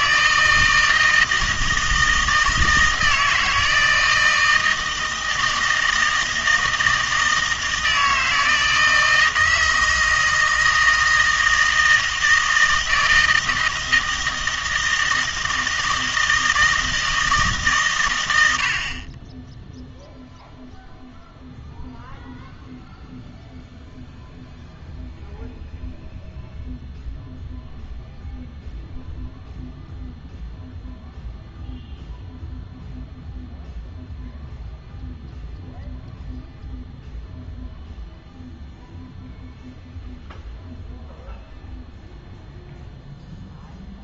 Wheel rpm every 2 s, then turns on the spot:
160, 160, 160, 160, 160, 160, 160, 160, 160, 50, 0, 0, 0, 0, 0, 0, 0, 0, 0, 0, 0, 0.
none